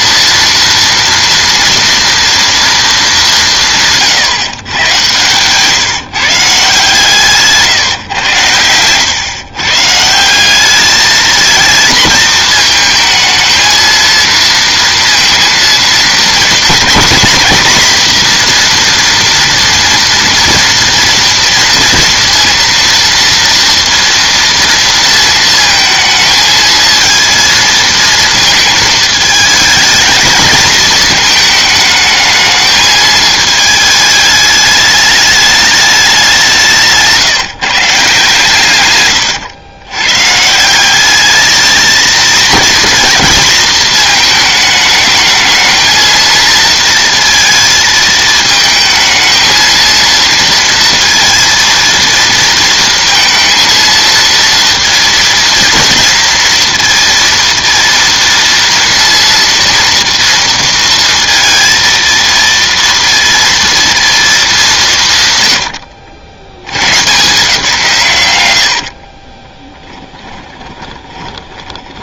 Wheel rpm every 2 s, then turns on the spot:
230, 230, 130, 140, 100, 200, 230, 230, 240, 240, 230, 230, 230, 220, 220, 220, 220, 210, 170, 140, 170, 230, 220, 230, 220, 230, 230, 230, 230, 230, 230, 230, 190, 110, 80, 20.
68-72